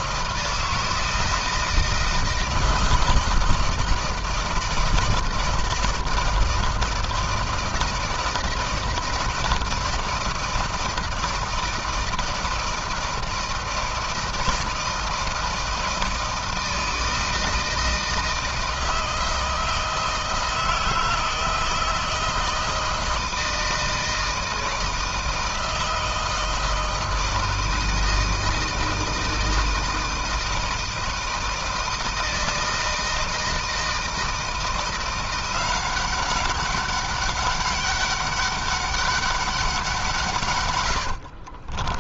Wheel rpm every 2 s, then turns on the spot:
160, 170, 160, 160, 170, 160, 160, 160, 160, 160, 160, 160, 160, 160, 160, 160, 160, 170, 200, 200, 110.
40-42